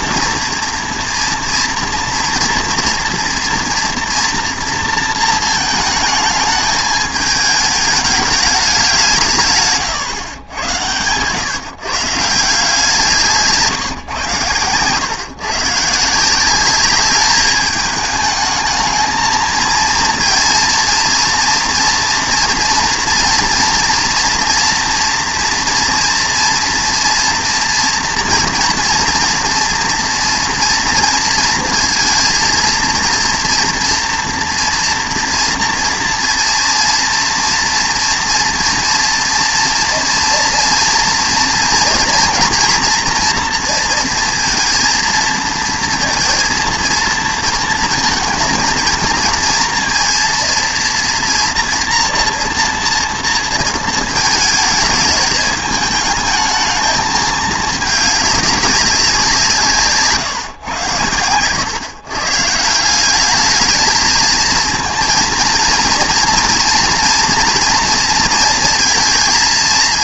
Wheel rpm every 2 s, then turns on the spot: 230, 230, 230, 220, 190, 100, 160, 110, 200, 220, 230, 240, 230, 230, 230, 230, 230, 230, 230, 240, 230, 240, 230, 230, 220, 230, 230, 220, 220, 200, 120, 160, 220, 230, 230.
none